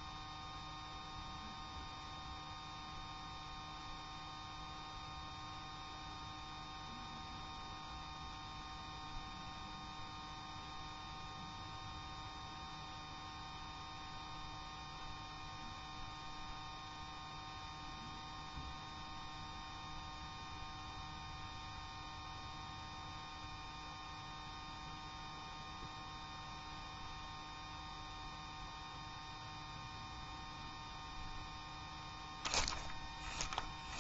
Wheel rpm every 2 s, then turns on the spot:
0, 0, 0, 0, 0, 0, 0, 0, 0, 0, 0, 0, 0, 0, 0, 0, 10.
none